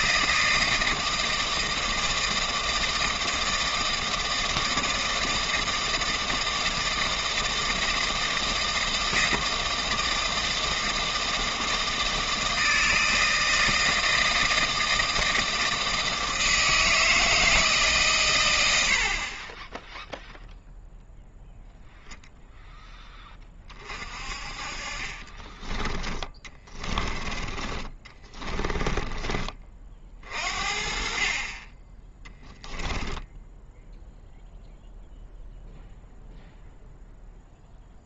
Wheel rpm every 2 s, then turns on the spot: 160, 160, 160, 160, 160, 170, 160, 160, 160, 70, 0, 10, 40, 20, 20, 50, 0, 0, 0.
26-30